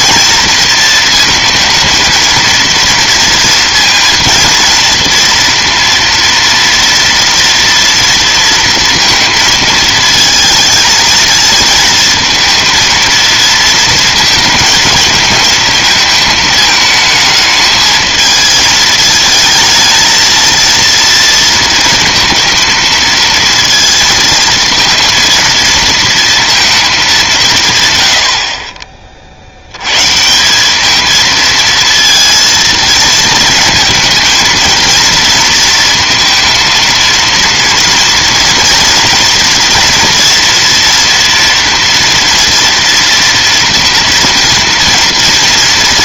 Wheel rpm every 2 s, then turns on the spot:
230, 230, 230, 230, 230, 220, 230, 230, 220, 220, 230, 220, 230, 220, 30, 190, 230, 230, 230, 230, 240, 230, 230.
none